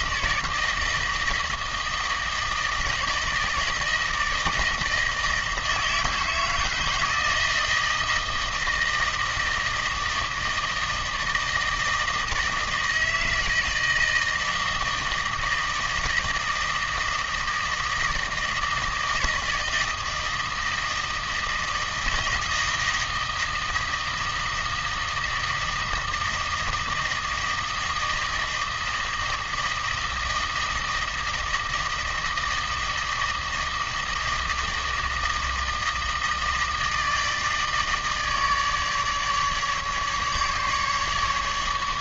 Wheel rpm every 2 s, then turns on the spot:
160, 160, 160, 160, 160, 160, 160, 160, 160, 160, 160, 160, 160, 160, 160, 160, 160, 160, 160, 150, 150.
none